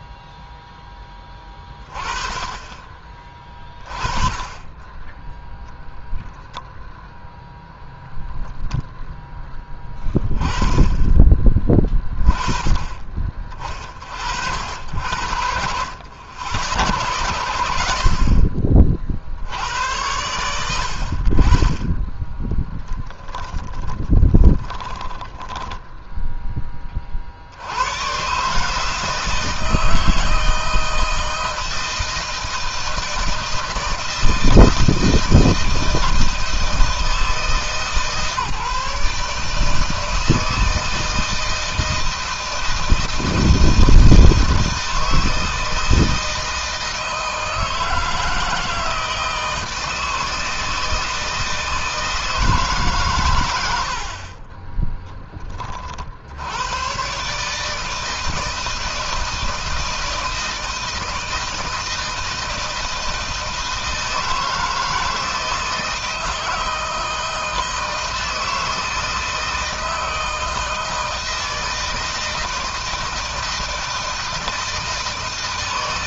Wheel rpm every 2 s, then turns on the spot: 10, 30, 20, 0, 10, 10, 20, 70, 70, 50, 70, 10, 10, 30, 150, 160, 160, 160, 160, 150, 160, 160, 160, 160, 160, 160, 140, 20, 120, 160, 160, 160, 160, 160, 160, 160, 160, 160.
22-26 54-56